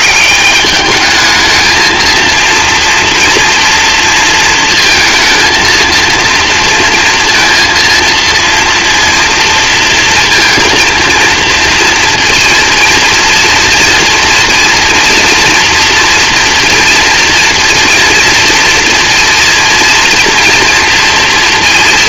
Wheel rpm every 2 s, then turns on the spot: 200, 240, 220, 230, 230, 230, 230, 230, 230, 230, 230.
none